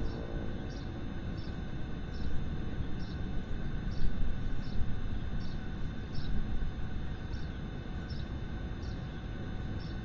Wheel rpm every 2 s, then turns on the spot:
0, 0, 0, 0, 0.
none